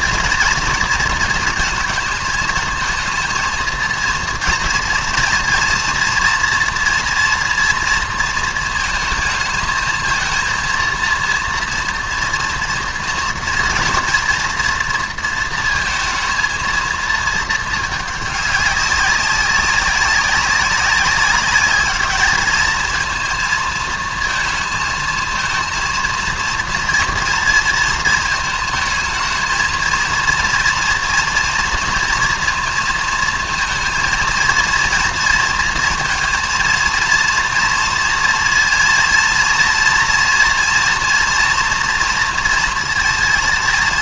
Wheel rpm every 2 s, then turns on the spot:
230, 220, 230, 230, 230, 230, 230, 230, 220, 210, 190, 210, 230, 230, 230, 230, 230, 230, 230, 230, 230, 230.
none